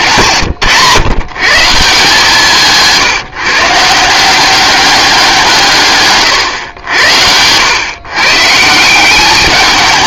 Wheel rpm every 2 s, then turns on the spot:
130, 160, 190, 90, 170.
2-4